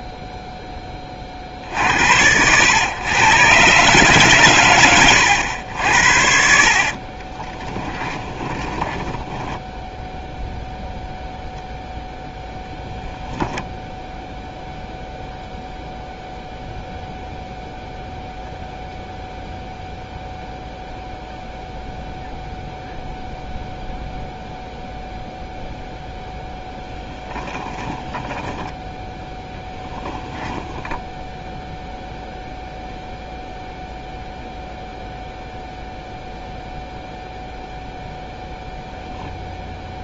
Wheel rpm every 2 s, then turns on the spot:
0, 100, 130, 60, 20, 0, 0, 0, 0, 0, 0, 0, 0, 0, 10, 0, 0, 0, 0, 0.
8-10 28-30